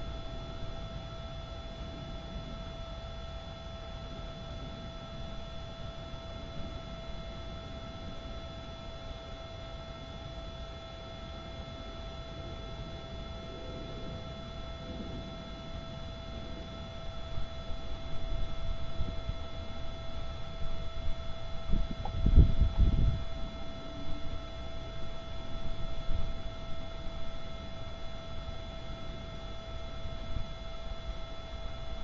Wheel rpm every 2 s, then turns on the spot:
0, 0, 0, 0, 0, 0, 0, 0, 0, 0, 0, 0, 0, 0, 0, 0.
none